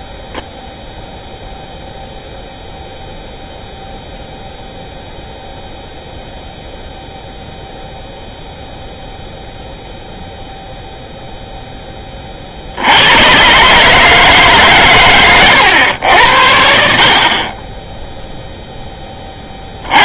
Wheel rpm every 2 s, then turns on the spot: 0, 0, 0, 0, 0, 0, 50, 150, 80, 0.
none